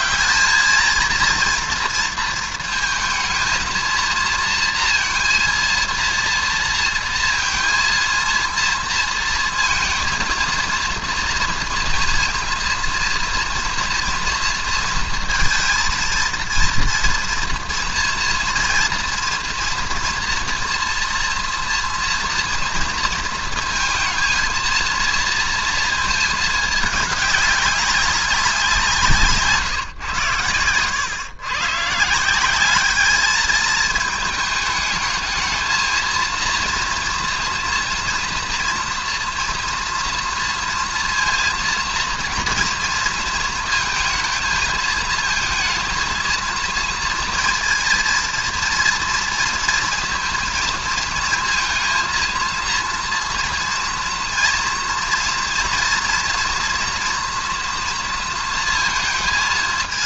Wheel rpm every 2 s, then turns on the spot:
220, 230, 230, 230, 230, 230, 230, 230, 230, 230, 240, 230, 230, 210, 170, 110, 210, 210, 230, 230, 230, 230, 220, 230, 230, 230, 230, 230, 230, 230.
none